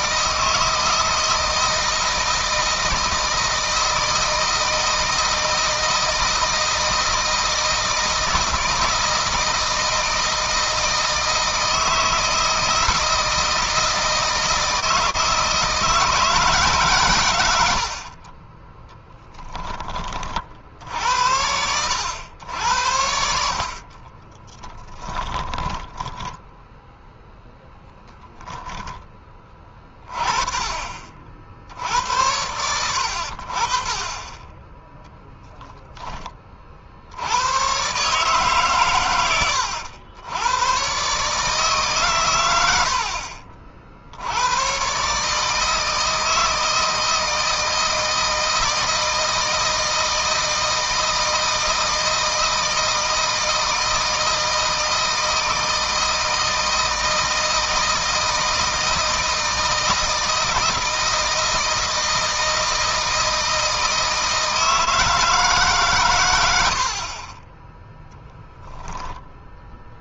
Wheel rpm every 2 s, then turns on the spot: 160, 160, 160, 160, 160, 160, 160, 160, 130, 10, 60, 80, 10, 0, 10, 40, 90, 10, 50, 130, 120, 80, 130, 160, 160, 160, 160, 160, 160, 160, 160, 160, 160, 70, 0.
18-20 24-26